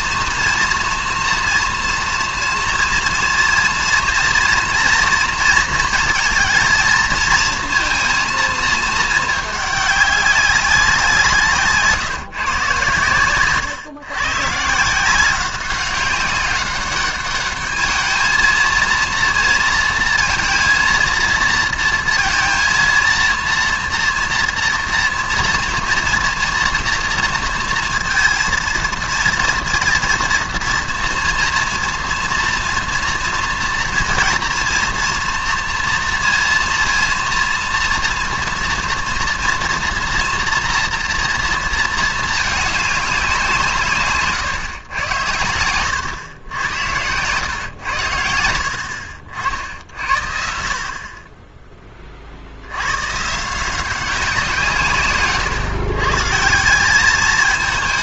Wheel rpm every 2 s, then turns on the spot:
230, 230, 230, 230, 220, 200, 140, 140, 200, 220, 230, 230, 230, 230, 230, 230, 230, 230, 230, 230, 230, 210, 130, 100, 80, 60, 70, 180, 170.
44-46